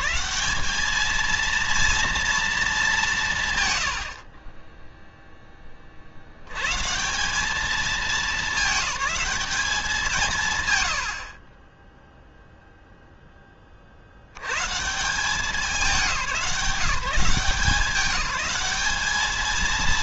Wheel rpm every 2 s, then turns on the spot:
210, 220, 30, 100, 210, 140, 0, 110, 160, 200.
none